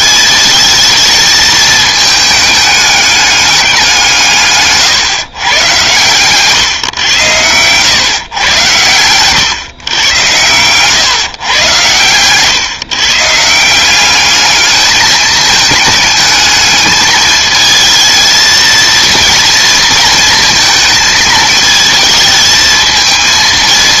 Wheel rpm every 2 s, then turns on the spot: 220, 210, 150, 130, 110, 120, 140, 210, 220, 230, 230, 220.
none